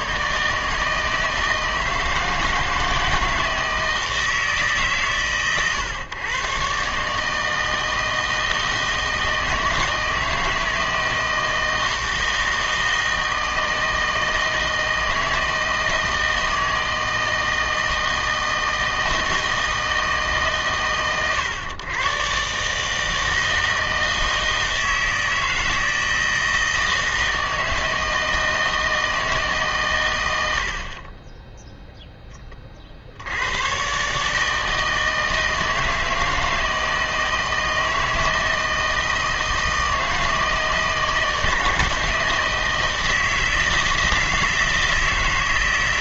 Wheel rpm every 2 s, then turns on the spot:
150, 160, 150, 130, 160, 160, 160, 160, 160, 160, 150, 140, 160, 160, 160, 80, 30, 160, 160, 160, 160, 160, 160.
none